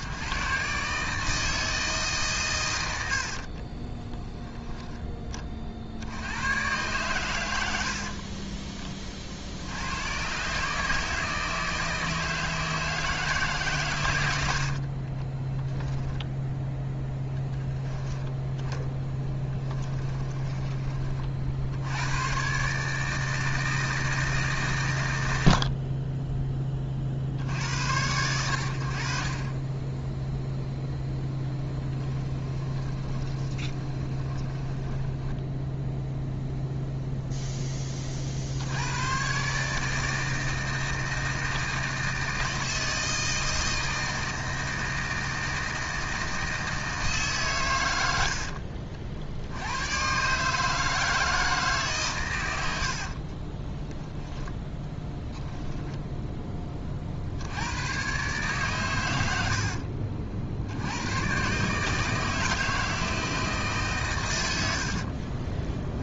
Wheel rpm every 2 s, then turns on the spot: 140, 100, 10, 110, 30, 140, 160, 60, 10, 10, 30, 140, 130, 20, 80, 0, 10, 10, 0, 80, 160, 160, 160, 160, 60, 150, 80, 10, 30, 130, 80, 160, 80.
14-16 18-20 32-36 48-50 54-56 64-66